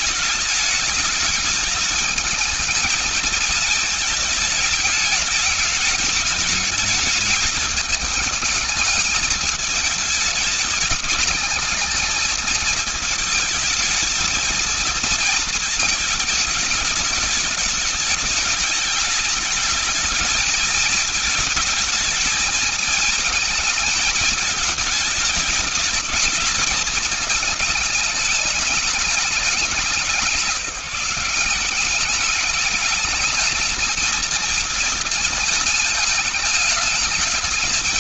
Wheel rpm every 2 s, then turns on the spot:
200, 220, 220, 210, 210, 210, 220, 220, 210, 210, 220, 210, 210, 210, 210, 170, 210, 220, 210.
none